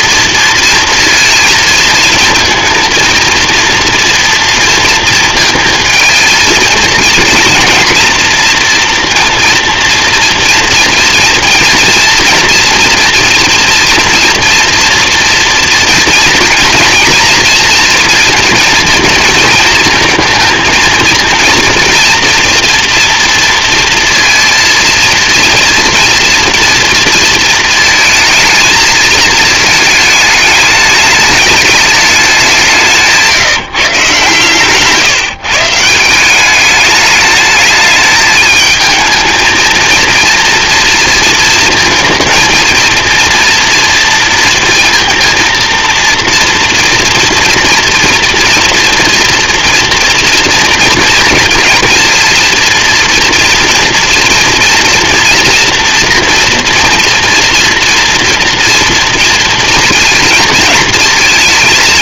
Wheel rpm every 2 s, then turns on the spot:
230, 230, 230, 230, 230, 230, 230, 230, 240, 230, 230, 230, 230, 230, 220, 210, 160, 140, 210, 220, 230, 230, 230, 230, 230, 230, 230, 230, 240, 230, 220.
none